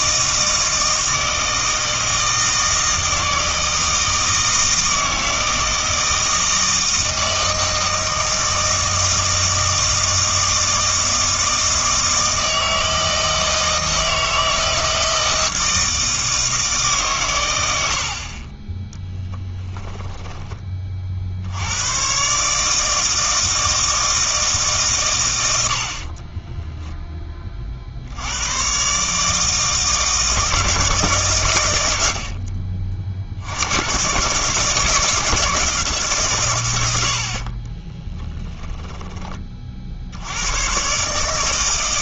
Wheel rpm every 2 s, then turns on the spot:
160, 160, 160, 160, 160, 160, 160, 160, 150, 20, 30, 150, 150, 10, 130, 160, 50, 150, 120, 20, 120.
18-20 38-40